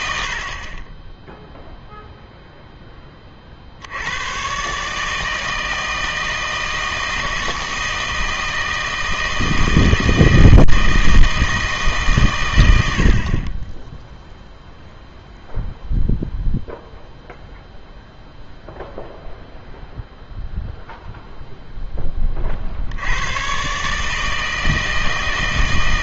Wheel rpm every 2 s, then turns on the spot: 40, 0, 130, 160, 160, 160, 110, 0, 0, 0, 0, 50, 160.
none